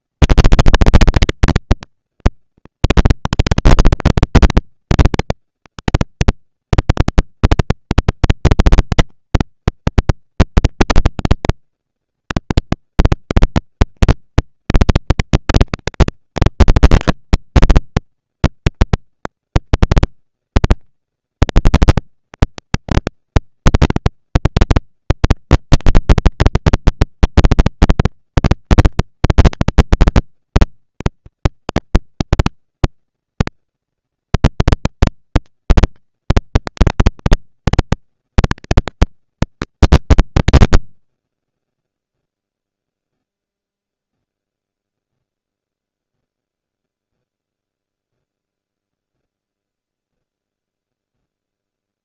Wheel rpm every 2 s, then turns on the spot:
230, 230, 230, 210, 200, 210, 230, 230, 230, 240, 230, 230, 230, 230, 230, 230, 230, 230, 230, 230, 150, 0, 0, 0, 0, 0.
none